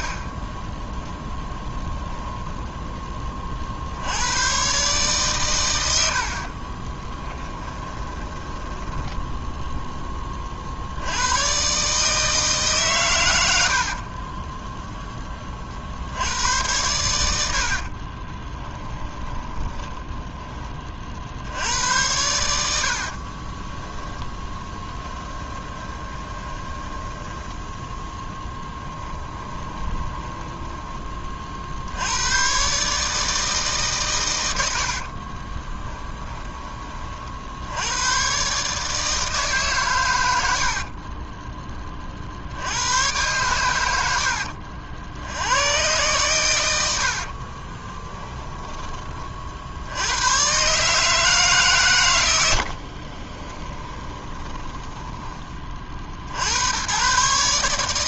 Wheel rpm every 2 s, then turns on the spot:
30, 20, 130, 30, 10, 80, 130, 10, 100, 20, 40, 60, 10, 10, 10, 20, 140, 70, 30, 150, 50, 100, 70, 90, 20, 140, 50, 10, 100.
2-4 6-10 18-20 24-30 34-36 40-42 46-48 52-56